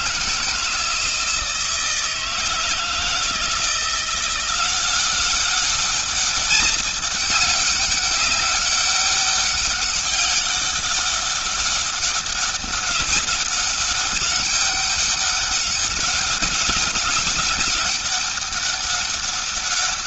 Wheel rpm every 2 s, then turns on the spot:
160, 160, 190, 200, 200, 200, 200, 200, 200, 200.
none